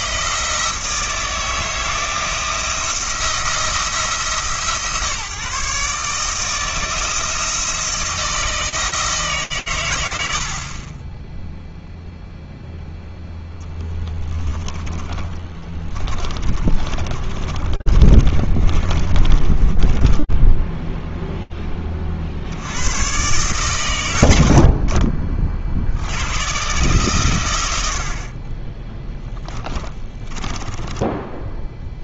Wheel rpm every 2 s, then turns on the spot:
160, 160, 160, 160, 160, 30, 0, 20, 30, 30, 0, 110, 40, 130, 10, 20.
14-20